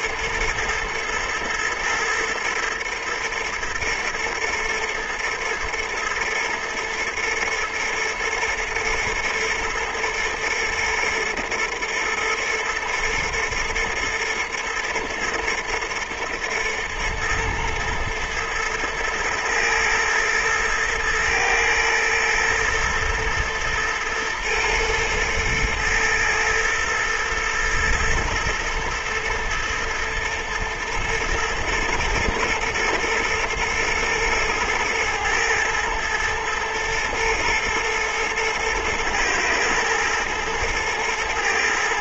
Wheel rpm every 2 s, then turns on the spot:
120, 110, 110, 110, 120, 120, 120, 120, 120, 110, 110, 120, 110, 110, 120, 110, 120, 110, 110, 110, 110.
none